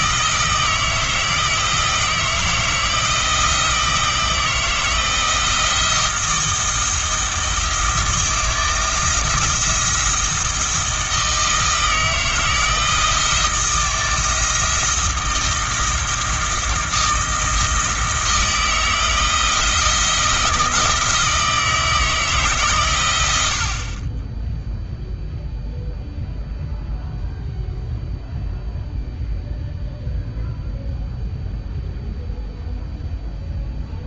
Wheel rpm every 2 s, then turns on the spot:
160, 160, 160, 170, 170, 160, 160, 170, 170, 170, 160, 130, 0, 0, 0, 0, 0.
none